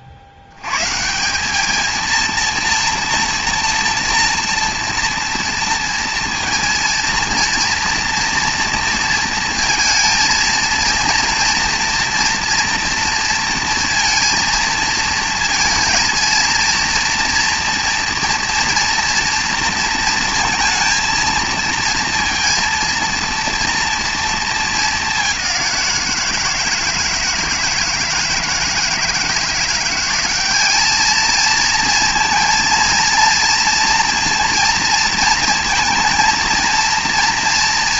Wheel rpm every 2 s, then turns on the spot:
130, 230, 230, 230, 240, 230, 230, 230, 230, 240, 230, 230, 220, 160, 160, 210, 230, 230, 230.
none